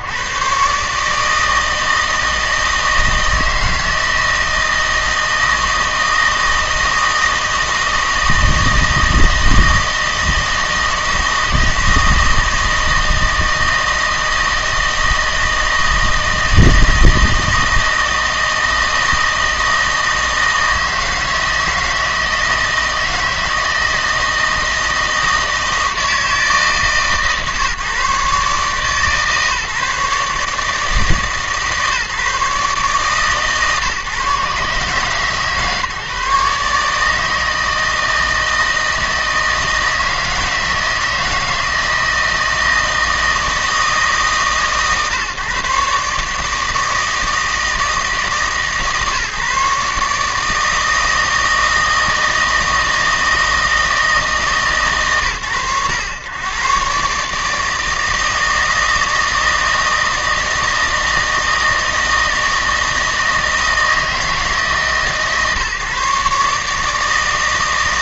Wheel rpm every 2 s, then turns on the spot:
70, 160, 160, 160, 160, 160, 160, 160, 160, 160, 160, 160, 160, 160, 140, 150, 150, 140, 150, 160, 160, 160, 140, 150, 160, 150, 160, 160, 110, 160, 160, 160, 160, 150.
none